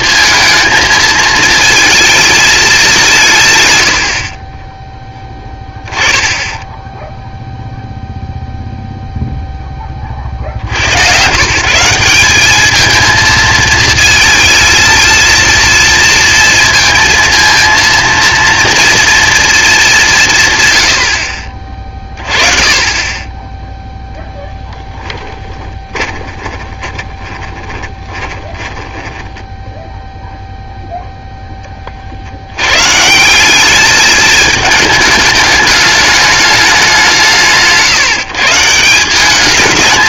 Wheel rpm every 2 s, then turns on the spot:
230, 220, 20, 10, 0, 70, 210, 230, 230, 230, 140, 30, 10, 20, 10, 0, 90, 220, 210, 160.
24-30